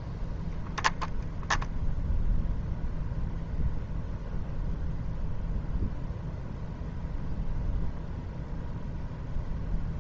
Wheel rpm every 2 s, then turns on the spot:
0, 0, 0, 0, 0.
none